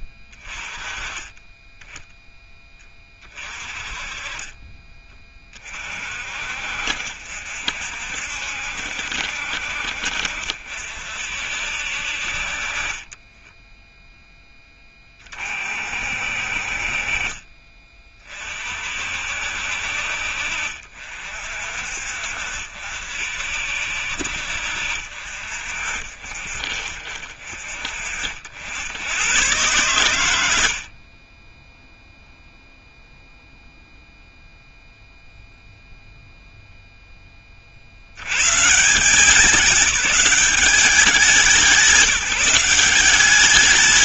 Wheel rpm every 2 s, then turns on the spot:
20, 10, 30, 60, 70, 50, 40, 10, 50, 40, 50, 60, 60, 50, 70, 70, 0, 0, 0, 140, 200, 170.
none